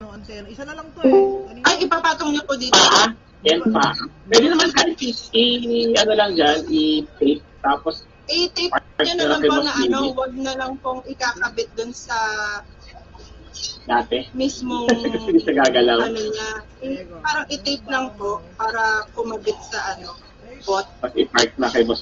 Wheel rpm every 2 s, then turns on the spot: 0, 0, 0, 0, 0, 0, 0, 0, 0, 0, 0.
none